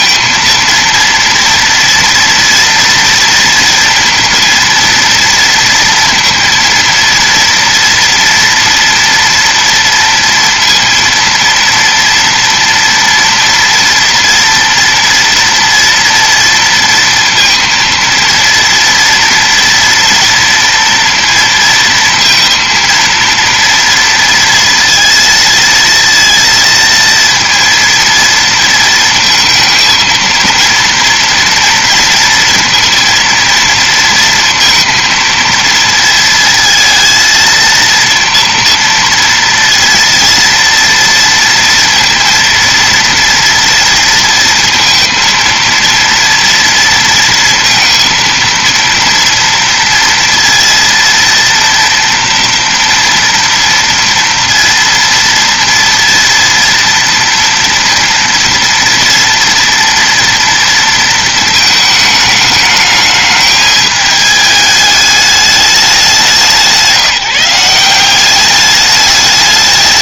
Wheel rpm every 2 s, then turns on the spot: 230, 230, 230, 230, 230, 230, 240, 240, 230, 230, 230, 230, 230, 230, 220, 230, 230, 230, 230, 230, 230, 230, 230, 230, 230, 230, 230, 230, 230, 230, 230, 210, 210, 160, 200.
none